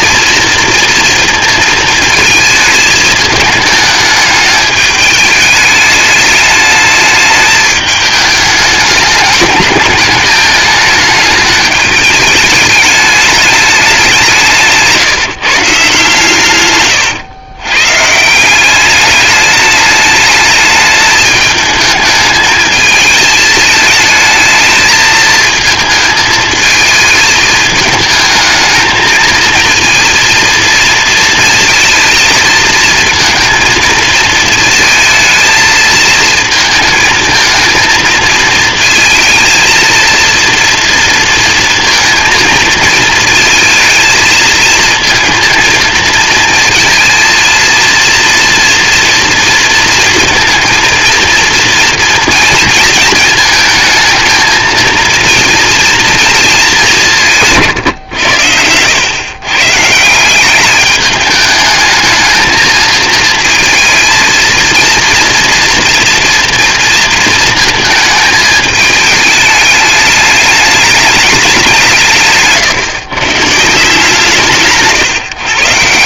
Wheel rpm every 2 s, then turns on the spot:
230, 220, 210, 210, 210, 210, 210, 150, 120, 200, 210, 220, 220, 220, 220, 230, 230, 230, 220, 220, 230, 220, 220, 220, 230, 230, 220, 230, 190, 100, 210, 220, 230, 230, 210, 210, 130, 150.
none